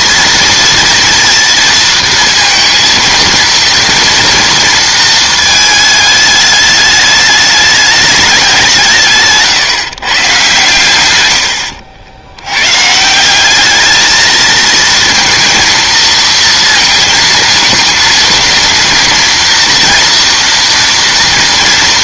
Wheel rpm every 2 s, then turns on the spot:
230, 230, 230, 210, 190, 140, 110, 230, 220, 230, 230.
none